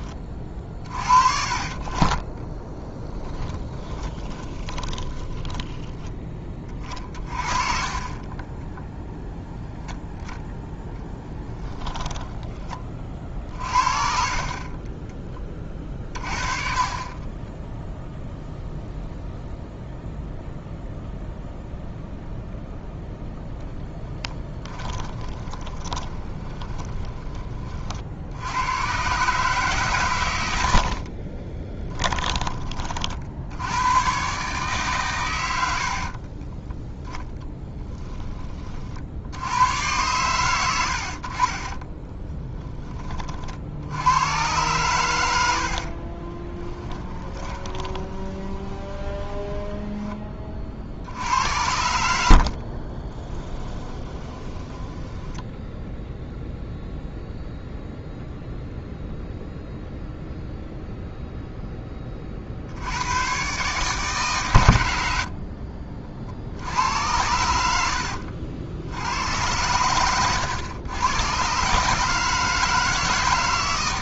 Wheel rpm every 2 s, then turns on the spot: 40, 10, 20, 30, 0, 0, 30, 20, 30, 0, 0, 0, 20, 20, 110, 60, 40, 140, 10, 50, 80, 20, 110, 20, 20, 60, 30, 10, 0, 0, 0, 90, 90, 80, 80, 100, 160.
2-6 16-18 24-28 30-32 36-38 46-50 52-56